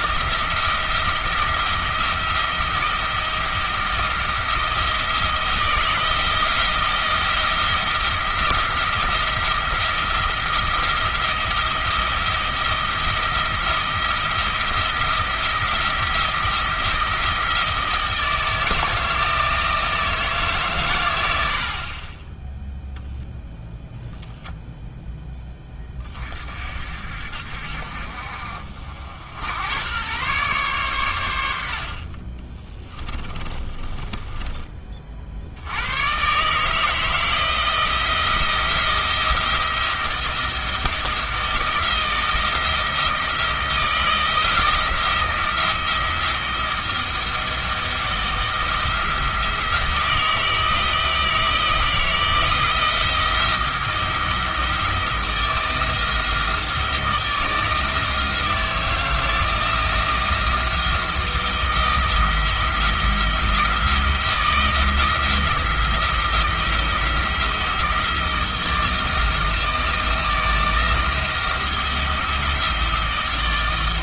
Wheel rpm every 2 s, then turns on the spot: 170, 170, 170, 160, 170, 170, 170, 170, 170, 160, 130, 0, 0, 50, 60, 120, 30, 30, 150, 160, 160, 160, 170, 170, 170, 160, 170, 170, 160, 160, 170, 170, 170, 170, 160, 170, 170.
32-34